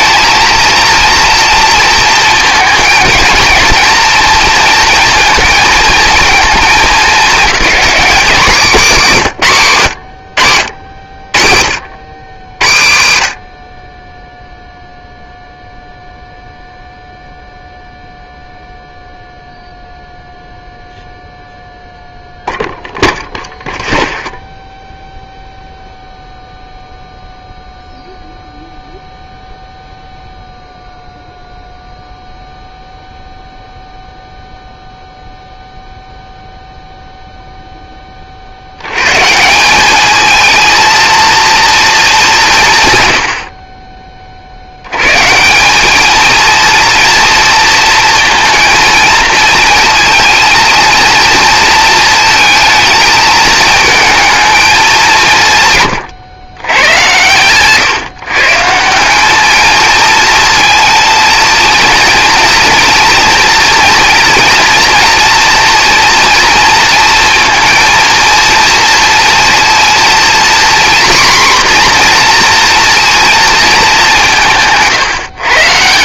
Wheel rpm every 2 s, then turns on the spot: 220, 230, 230, 220, 200, 70, 60, 0, 0, 0, 0, 0, 0, 0, 0, 0, 0, 0, 0, 160, 230, 60, 160, 230, 230, 230, 220, 150, 110, 200, 230, 230, 240, 230, 230, 250, 230, 150.
none